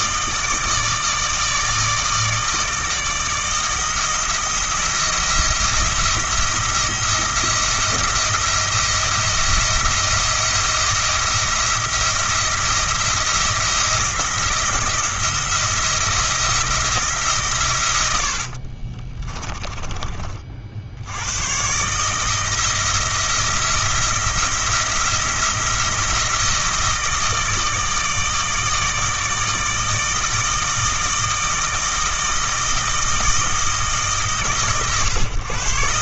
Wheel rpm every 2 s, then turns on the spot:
160, 160, 170, 170, 170, 170, 170, 170, 170, 70, 50, 160, 170, 170, 160, 160, 160, 140.
18-20